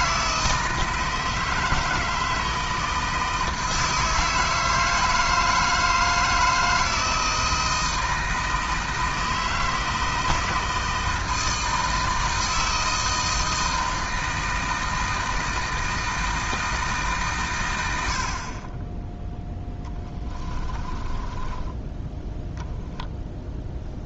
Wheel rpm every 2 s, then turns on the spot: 160, 160, 160, 160, 160, 160, 160, 160, 150, 20, 20, 0.
20-22